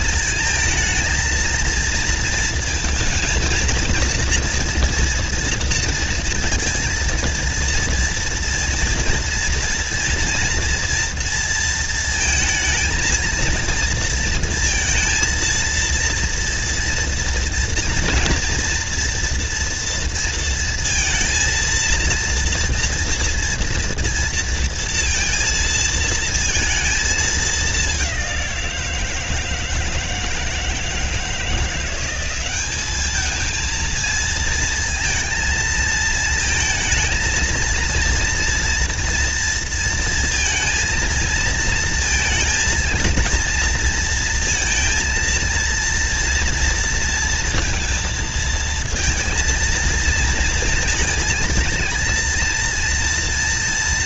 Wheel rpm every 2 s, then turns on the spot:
220, 230, 230, 230, 230, 230, 230, 230, 230, 230, 230, 230, 230, 220, 170, 160, 210, 230, 220, 230, 230, 230, 230, 230, 220, 230, 240.
none